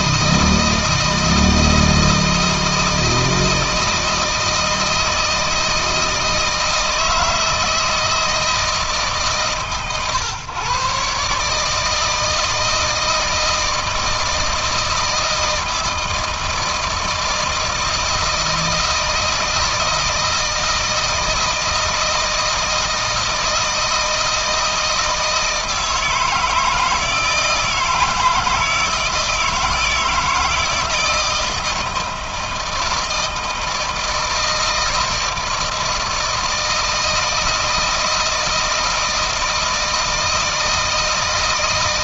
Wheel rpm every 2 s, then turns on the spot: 160, 160, 160, 160, 150, 140, 160, 160, 160, 160, 160, 160, 160, 160, 160, 160, 160, 160, 160, 160, 160.
none